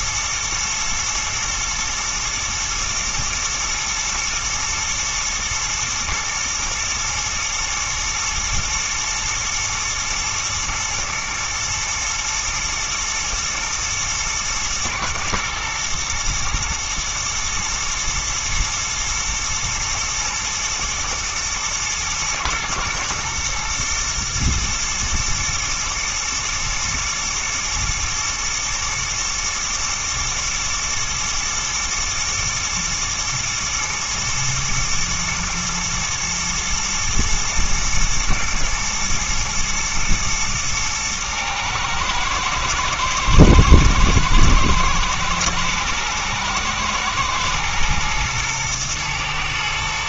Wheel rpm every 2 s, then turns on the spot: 120, 110, 120, 110, 110, 120, 110, 110, 110, 110, 110, 110, 120, 120, 110, 110, 120, 120, 110, 120, 110, 110, 110, 110, 110.
none